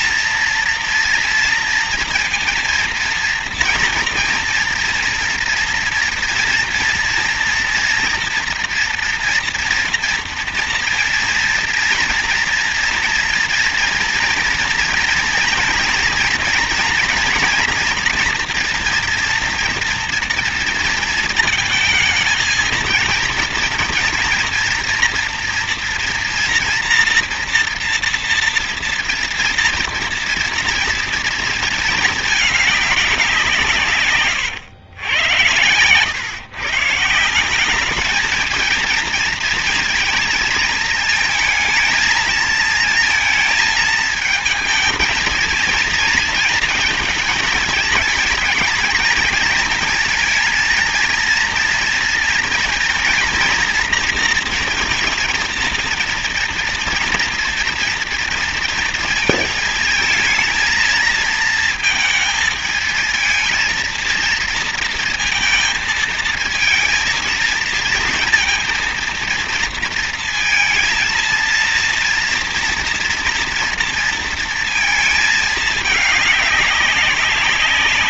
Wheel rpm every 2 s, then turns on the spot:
230, 230, 230, 230, 240, 240, 230, 230, 230, 230, 230, 230, 240, 230, 230, 230, 200, 110, 160, 230, 230, 230, 220, 220, 230, 230, 230, 230, 230, 230, 230, 220, 230, 220, 230, 230, 230, 230, 200.
none